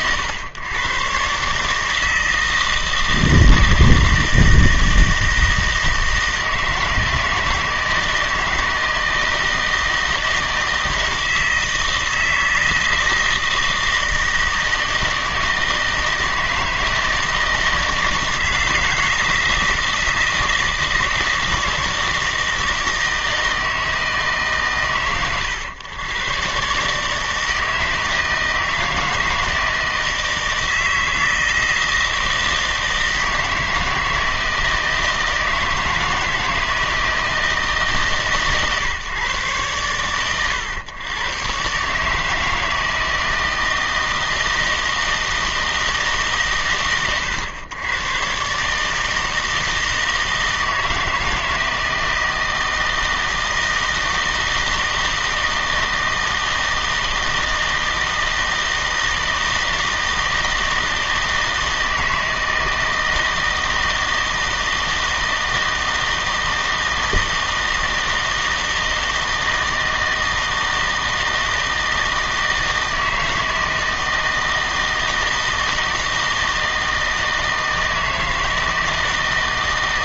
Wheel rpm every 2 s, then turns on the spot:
110, 160, 160, 160, 160, 160, 160, 160, 160, 170, 160, 160, 130, 130, 160, 160, 160, 160, 160, 140, 100, 160, 160, 110, 150, 160, 160, 160, 160, 160, 160, 160, 160, 160, 160, 160, 160, 160, 160, 160.
none